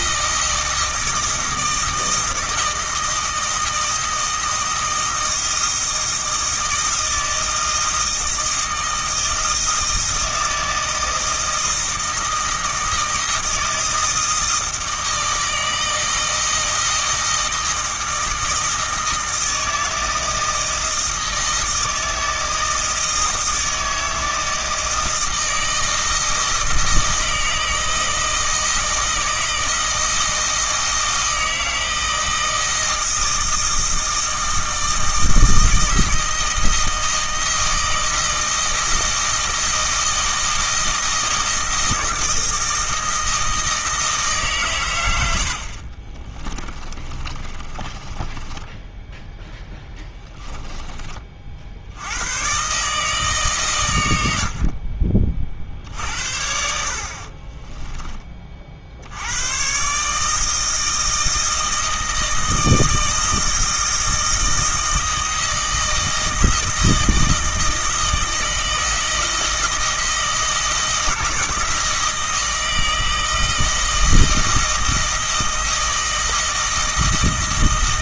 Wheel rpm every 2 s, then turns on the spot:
160, 160, 160, 160, 160, 160, 160, 160, 160, 160, 160, 160, 160, 160, 160, 160, 160, 160, 160, 160, 160, 160, 120, 40, 10, 20, 140, 40, 60, 60, 160, 160, 160, 160, 160, 160, 160, 160, 160.
46-50